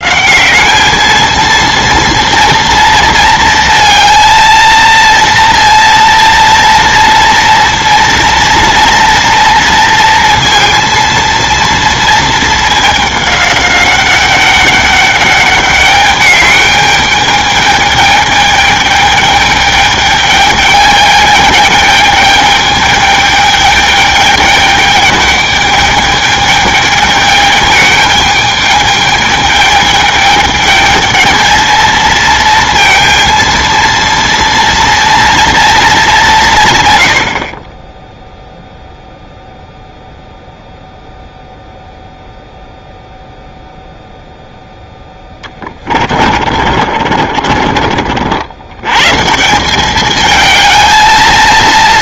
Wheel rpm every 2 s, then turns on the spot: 210, 230, 230, 230, 230, 230, 210, 200, 210, 210, 210, 210, 210, 210, 210, 210, 230, 230, 140, 0, 0, 0, 0, 40, 90, 220.
46-48